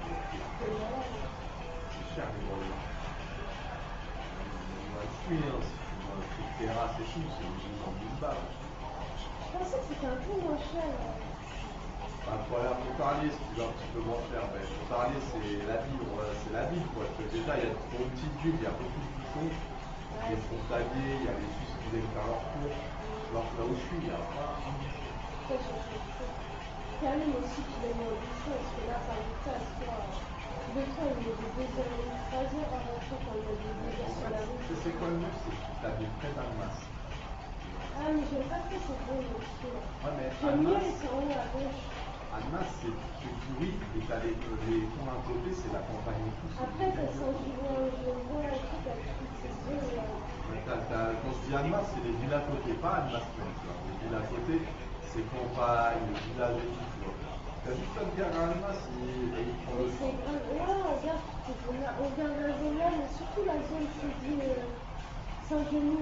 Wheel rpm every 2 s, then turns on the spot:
0, 0, 0, 0, 0, 0, 0, 0, 0, 0, 0, 0, 0, 0, 0, 0, 0, 0, 0, 0, 0, 0, 0, 0, 0, 0, 0, 0, 0, 0, 0, 0, 0.
none